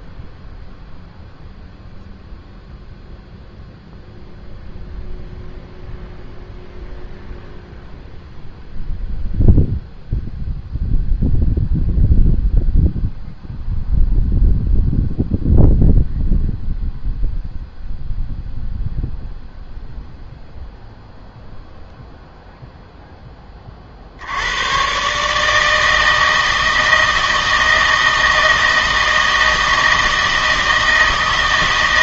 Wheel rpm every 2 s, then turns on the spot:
0, 0, 0, 0, 0, 0, 0, 0, 0, 0, 0, 0, 100, 160, 160, 160.
none